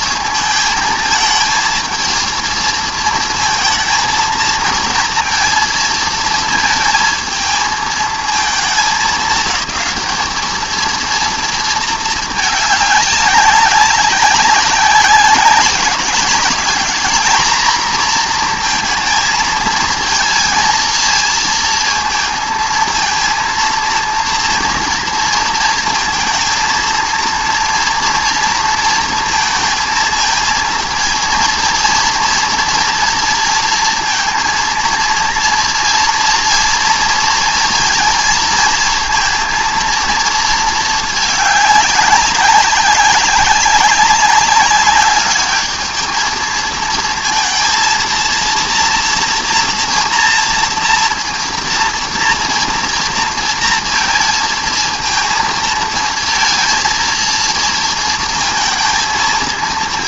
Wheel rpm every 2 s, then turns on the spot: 220, 230, 230, 220, 220, 220, 200, 190, 220, 230, 220, 230, 230, 230, 230, 230, 230, 230, 230, 230, 220, 200, 200, 230, 230, 230, 230, 230, 230, 220.
none